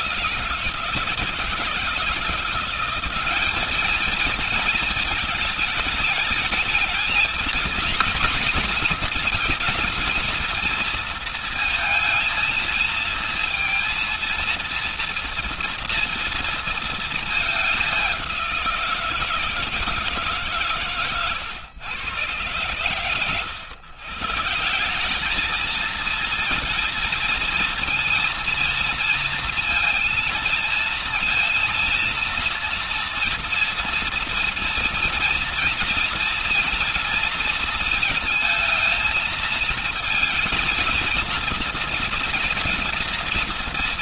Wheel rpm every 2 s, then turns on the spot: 170, 170, 220, 220, 240, 230, 230, 230, 230, 180, 140, 120, 150, 220, 230, 230, 240, 230, 230, 230, 230, 230.
none